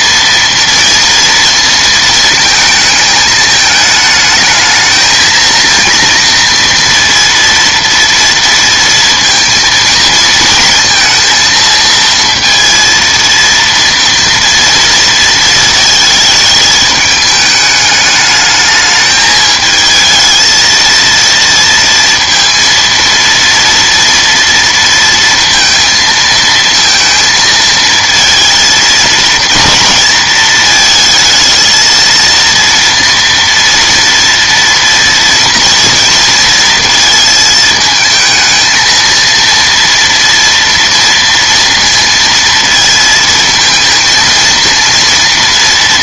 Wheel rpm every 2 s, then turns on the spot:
230, 220, 220, 230, 230, 220, 230, 230, 220, 210, 230, 230, 230, 230, 230, 220, 230, 230, 230, 230, 230, 230, 230.
none